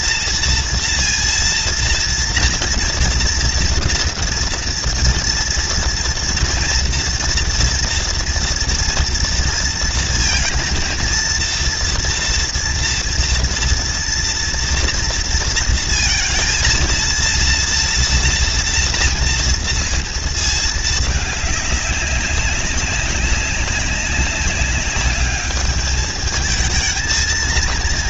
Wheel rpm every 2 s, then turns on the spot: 230, 230, 230, 230, 240, 230, 230, 230, 230, 230, 220, 200, 200, 220.
none